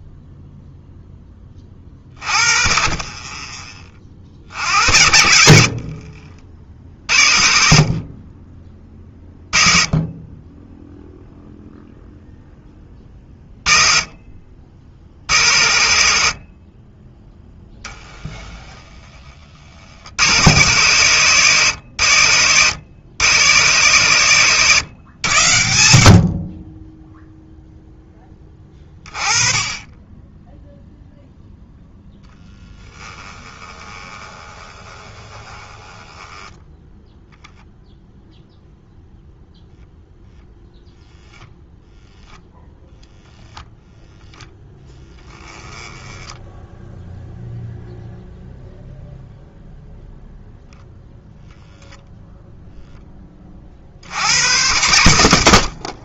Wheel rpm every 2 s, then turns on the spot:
0, 40, 70, 50, 20, 10, 10, 60, 40, 10, 110, 90, 120, 30, 20, 0, 10, 20, 10, 0, 0, 0, 10, 10, 0, 0, 0, 100.
32-38 44-48